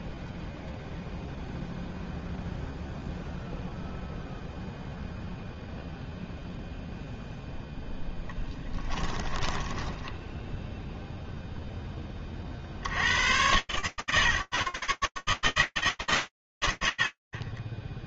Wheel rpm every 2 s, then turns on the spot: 0, 0, 0, 0, 10, 40, 140, 160, 150.
8-10